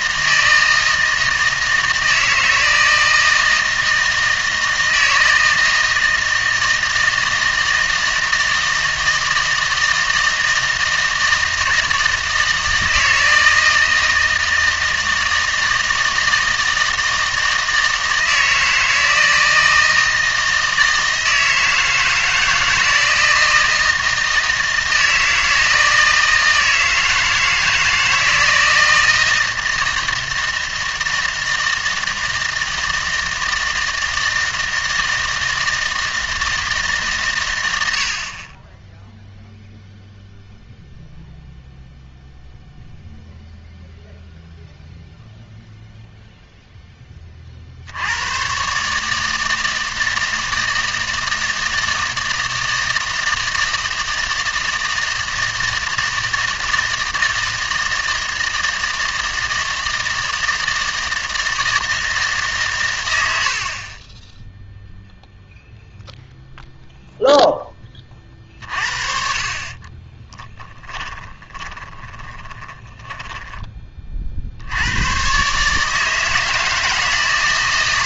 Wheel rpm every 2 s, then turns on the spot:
160, 160, 160, 160, 160, 160, 160, 160, 160, 160, 160, 160, 160, 160, 160, 160, 160, 160, 150, 10, 0, 0, 0, 0, 140, 160, 160, 160, 160, 160, 160, 130, 0, 0, 40, 10, 20, 90, 160.
70-74